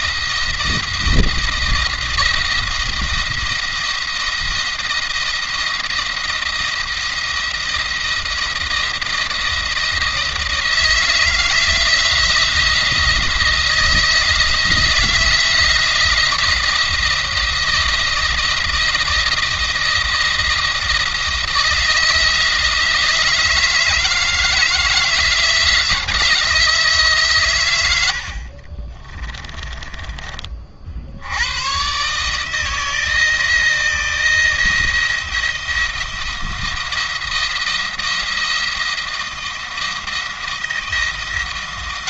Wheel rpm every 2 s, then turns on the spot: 170, 170, 170, 170, 160, 160, 170, 170, 170, 170, 170, 160, 160, 160, 40, 60, 160, 170, 170, 170, 170.
28-30